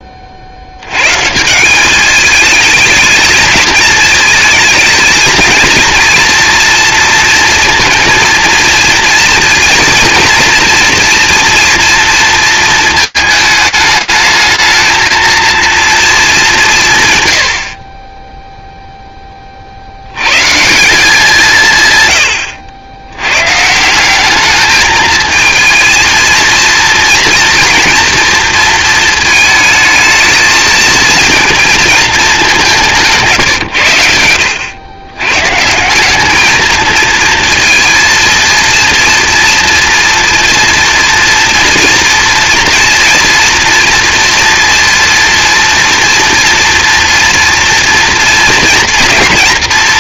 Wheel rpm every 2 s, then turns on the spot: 80, 210, 220, 230, 230, 240, 230, 220, 160, 10, 180, 90, 220, 230, 230, 230, 170, 100, 220, 230, 230, 230, 230, 230, 230.
none